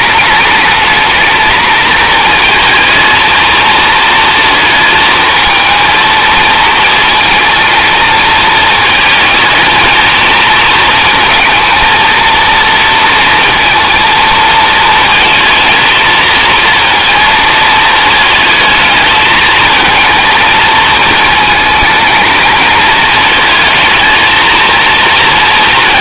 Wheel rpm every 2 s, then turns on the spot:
220, 230, 220, 220, 220, 230, 230, 230, 230, 220, 220, 220, 230.
none